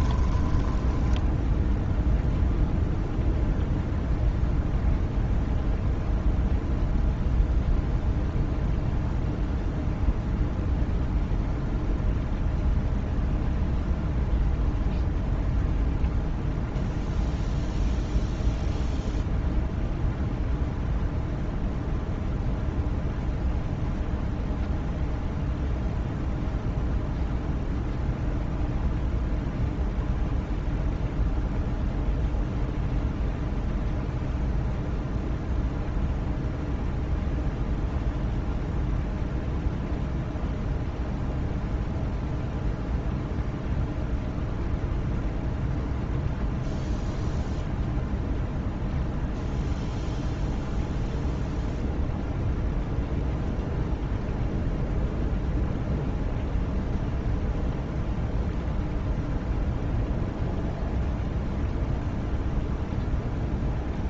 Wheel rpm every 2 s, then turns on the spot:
10, 0, 0, 0, 0, 0, 0, 0, 0, 0, 0, 0, 0, 0, 0, 0, 0, 0, 0, 0, 0, 0, 0, 0, 0, 0, 0, 0, 0, 0, 0, 0.
0-2